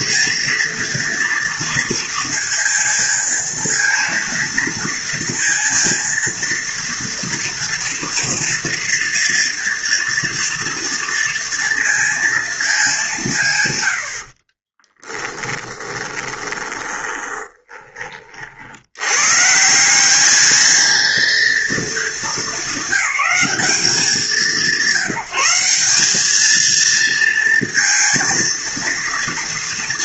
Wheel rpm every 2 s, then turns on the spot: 230, 230, 230, 230, 240, 230, 180, 20, 20, 130, 230, 200, 190, 230, 230.
14-18